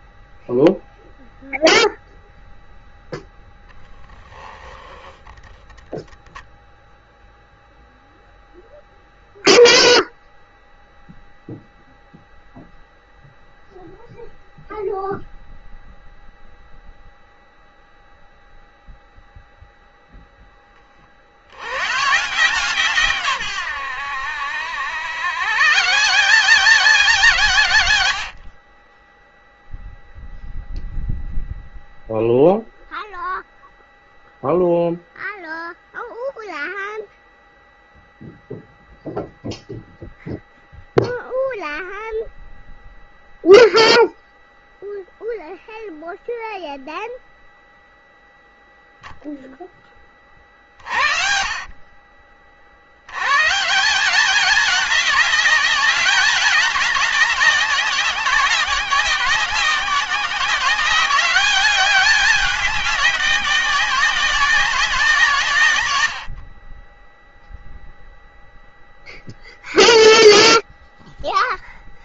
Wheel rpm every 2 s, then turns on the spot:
0, 0, 20, 0, 0, 0, 0, 0, 0, 0, 10, 140, 90, 170, 50, 0, 0, 0, 0, 0, 0, 0, 0, 0, 0, 40, 60, 200, 200, 190, 180, 200, 180, 70, 0, 0.
4-6 28-30